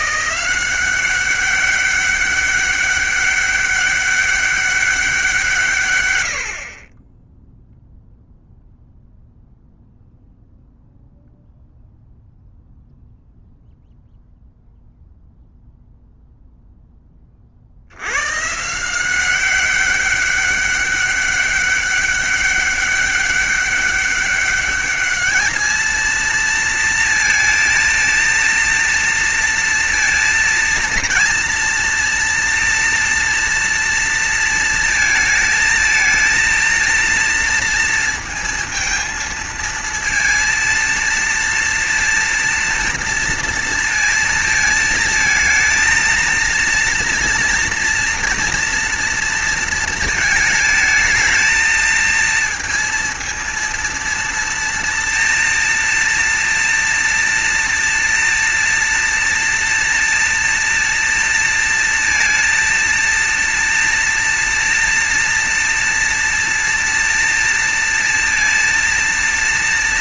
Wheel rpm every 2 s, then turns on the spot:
180, 200, 200, 60, 0, 0, 0, 0, 0, 140, 200, 200, 200, 230, 230, 230, 230, 230, 230, 230, 230, 230, 230, 230, 230, 220, 230, 230, 230, 230, 230, 230, 240, 230, 230.
none